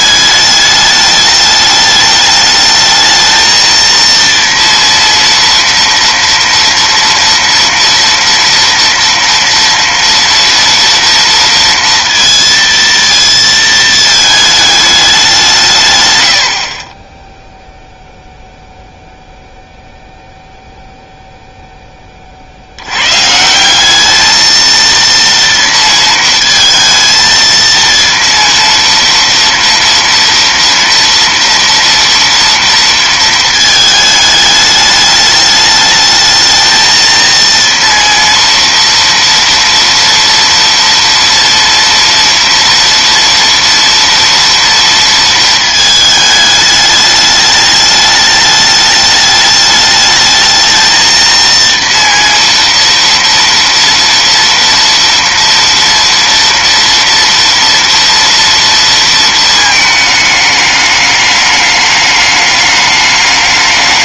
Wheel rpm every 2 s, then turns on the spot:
210, 220, 230, 230, 230, 230, 230, 210, 50, 0, 0, 70, 220, 220, 230, 230, 230, 210, 220, 230, 230, 230, 230, 210, 210, 220, 230, 230, 230, 230, 210, 210.
none